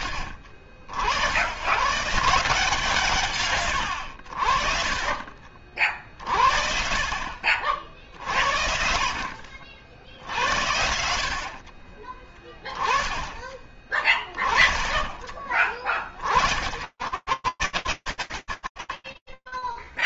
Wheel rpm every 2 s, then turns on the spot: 70, 160, 50, 50, 60, 60, 20, 30, 50, 0.
none